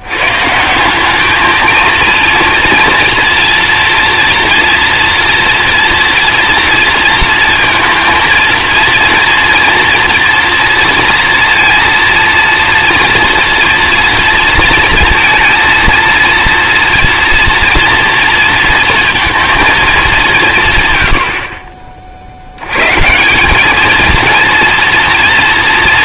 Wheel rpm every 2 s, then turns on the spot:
140, 230, 230, 230, 230, 230, 230, 240, 230, 230, 200, 60, 230.
none